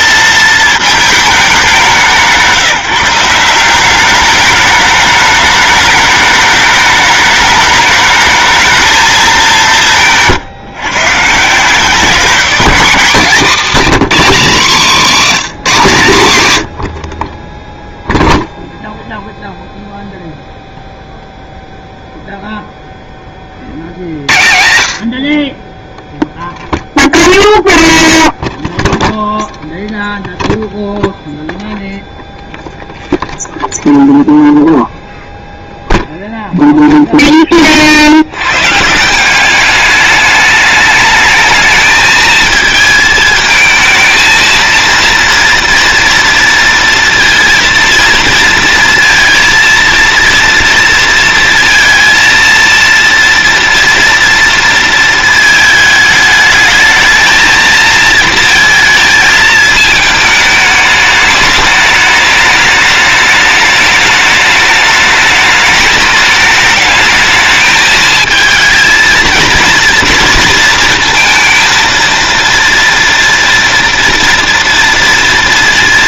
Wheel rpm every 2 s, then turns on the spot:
220, 160, 210, 210, 220, 140, 190, 160, 80, 0, 0, 0, 80, 0, 0, 0, 0, 0, 0, 140, 210, 220, 230, 230, 230, 230, 230, 230, 220, 230, 210, 210, 210, 210, 230, 230, 230, 230.
none